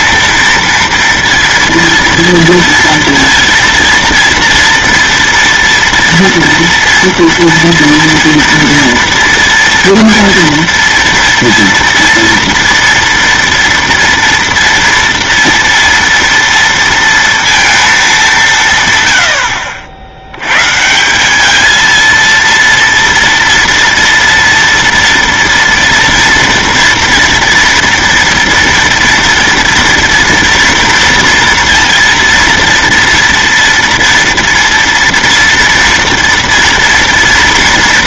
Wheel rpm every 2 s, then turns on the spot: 230, 230, 230, 230, 230, 230, 230, 230, 230, 150, 130, 230, 230, 240, 230, 230, 230, 230, 230.
none